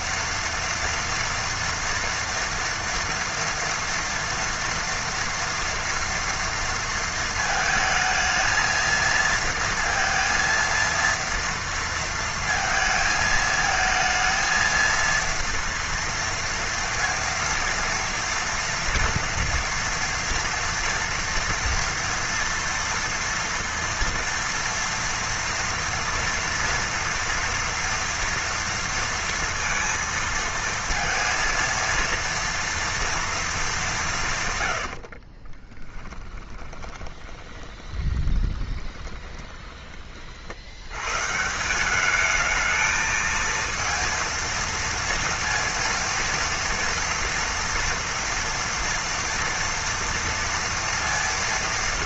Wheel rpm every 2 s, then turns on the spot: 230, 230, 230, 230, 220, 230, 230, 230, 230, 230, 230, 230, 230, 230, 230, 230, 230, 140, 20, 20, 70, 220, 230, 230, 230, 230.
36-40